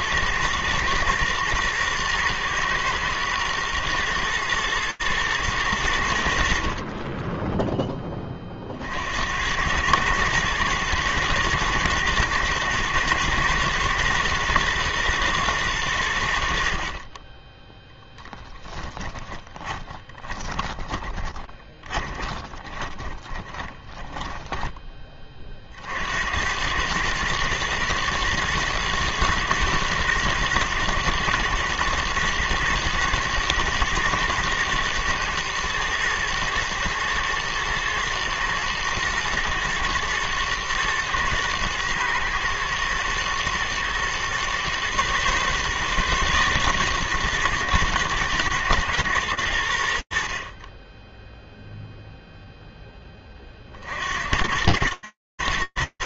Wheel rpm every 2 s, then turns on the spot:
110, 110, 110, 50, 40, 110, 120, 120, 60, 10, 20, 20, 10, 100, 120, 110, 110, 120, 120, 120, 110, 110, 120, 120, 110, 10, 20, 110.
18-26